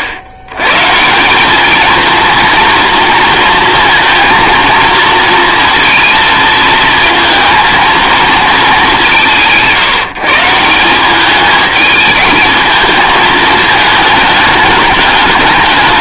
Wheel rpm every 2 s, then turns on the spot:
120, 230, 230, 220, 180, 170, 220, 210.
none